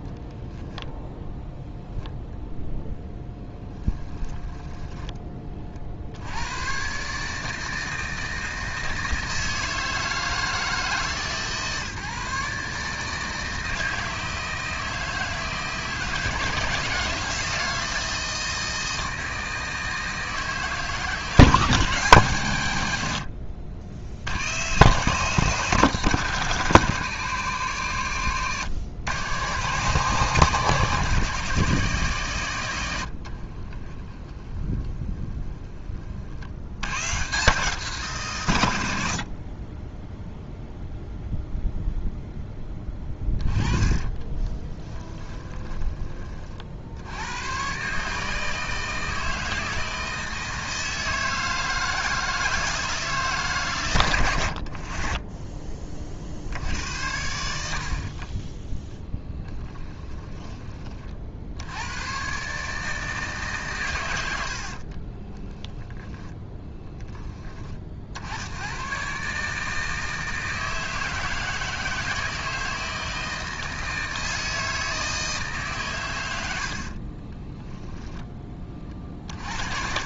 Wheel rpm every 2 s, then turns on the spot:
0, 0, 10, 120, 160, 150, 150, 160, 170, 160, 150, 100, 140, 150, 120, 150, 110, 10, 90, 90, 0, 10, 10, 60, 160, 160, 160, 80, 90, 10, 30, 150, 60, 10, 120, 160, 160, 160, 70, 40.
4-6 34-36 42-46 58-60 64-68